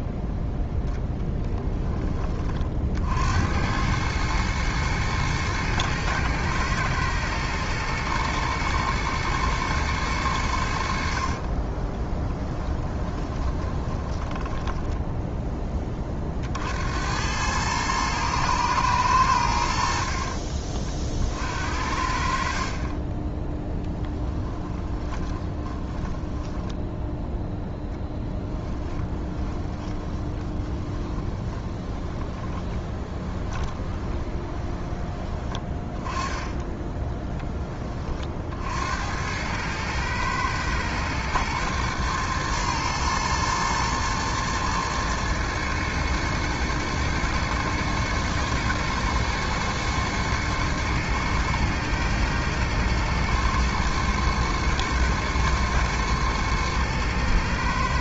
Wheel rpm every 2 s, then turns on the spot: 0, 50, 110, 110, 120, 70, 20, 10, 70, 110, 50, 30, 10, 10, 10, 20, 20, 20, 10, 70, 120, 120, 110, 110, 110, 110, 120, 120, 120.
12-16 24-38